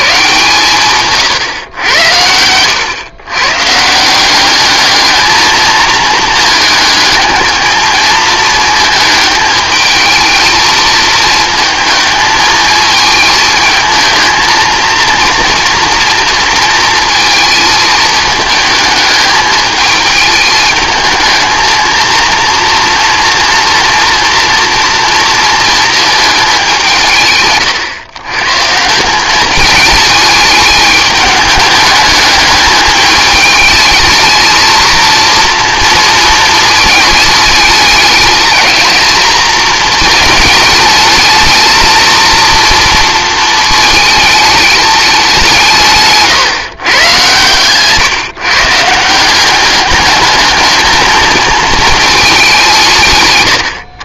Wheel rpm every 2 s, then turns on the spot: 140, 110, 200, 220, 220, 220, 220, 230, 230, 220, 220, 230, 240, 200, 150, 210, 210, 230, 230, 220, 220, 230, 210, 140, 150, 220, 180.
none